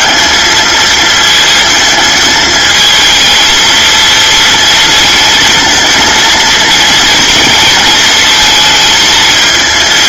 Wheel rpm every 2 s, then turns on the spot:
220, 220, 220, 230, 220.
none